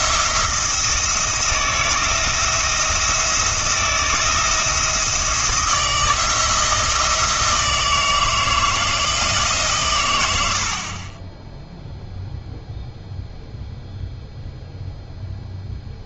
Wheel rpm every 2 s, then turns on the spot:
170, 170, 170, 160, 170, 70, 0, 0.
none